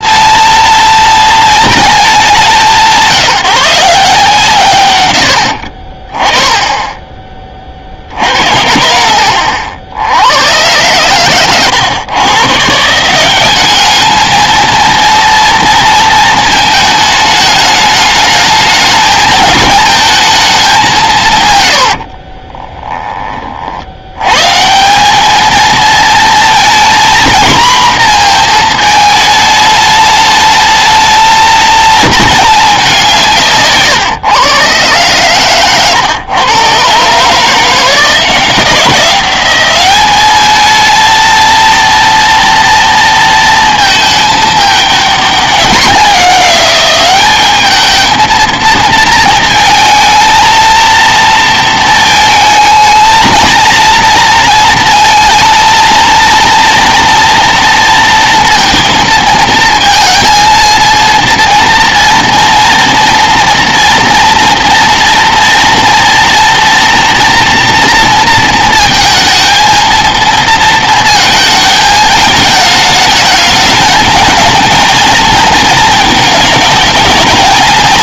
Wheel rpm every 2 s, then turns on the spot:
220, 190, 140, 20, 70, 110, 150, 230, 220, 220, 200, 20, 140, 230, 230, 220, 210, 120, 120, 180, 220, 230, 210, 190, 230, 230, 220, 230, 230, 230, 230, 230, 230, 230, 230, 230, 210, 230, 220.
8-10 22-24